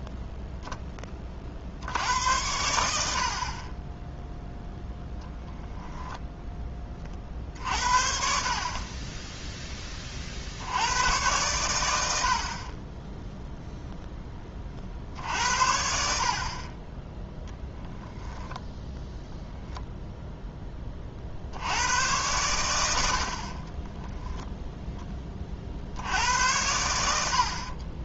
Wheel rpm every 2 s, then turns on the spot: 0, 80, 0, 10, 40, 80, 30, 40, 30, 10, 10, 100, 0, 90.
none